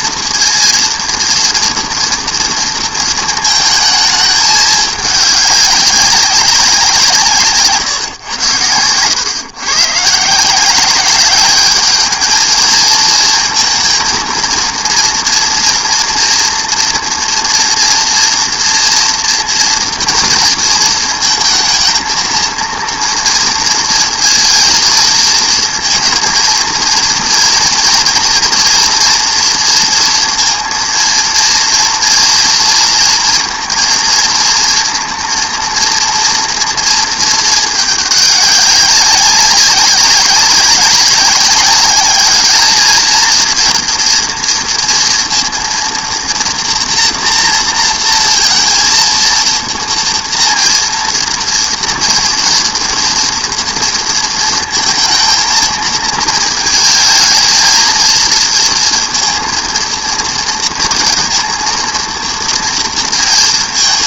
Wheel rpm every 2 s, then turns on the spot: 230, 230, 210, 180, 100, 180, 220, 230, 230, 230, 230, 230, 230, 230, 230, 230, 230, 230, 230, 200, 190, 210, 230, 230, 230, 230, 230, 230, 220, 230, 230, 230.
none